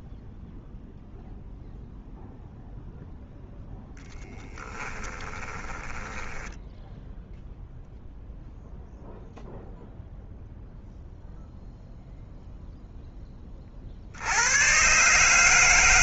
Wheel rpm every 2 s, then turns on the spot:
0, 0, 10, 10, 0, 0, 0, 110.
4-6